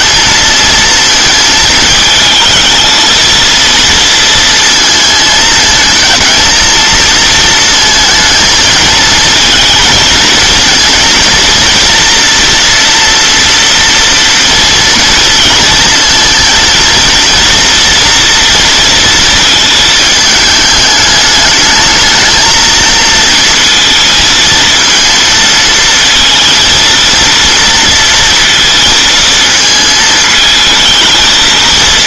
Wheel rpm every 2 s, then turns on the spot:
220, 230, 230, 220, 220, 230, 230, 230, 230, 230, 210, 220, 230, 230, 230, 220.
none